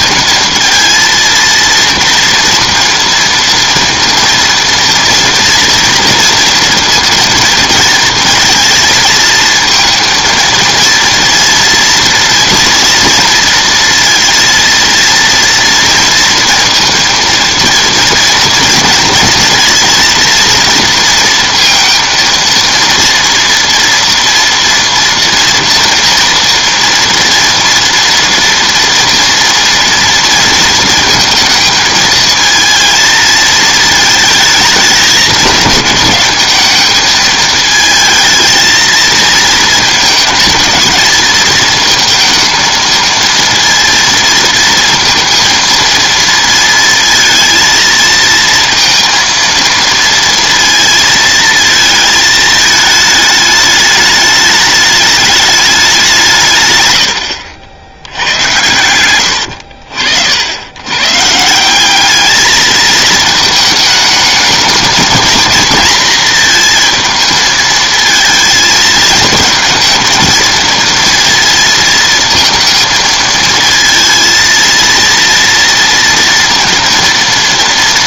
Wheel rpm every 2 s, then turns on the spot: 230, 230, 230, 230, 220, 230, 230, 230, 230, 230, 230, 230, 230, 230, 230, 230, 230, 210, 210, 230, 220, 230, 230, 230, 230, 230, 220, 210, 150, 100, 100, 220, 220, 230, 220, 230, 230, 230, 230.
58-60